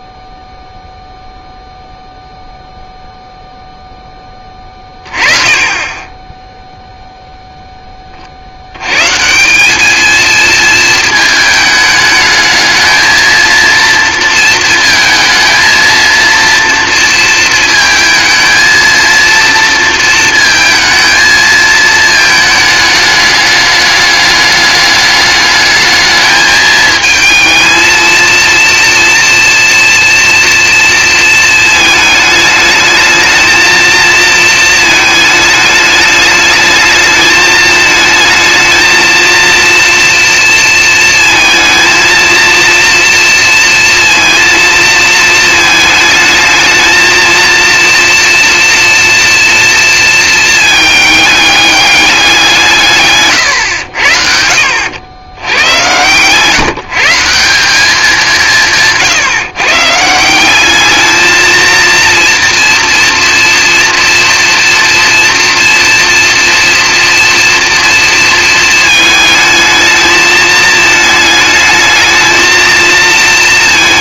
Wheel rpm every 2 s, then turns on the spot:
0, 0, 20, 0, 90, 220, 220, 230, 230, 230, 230, 220, 210, 220, 230, 230, 210, 220, 220, 230, 230, 230, 230, 220, 230, 220, 160, 80, 150, 160, 200, 240, 230, 230, 220, 220, 230.
none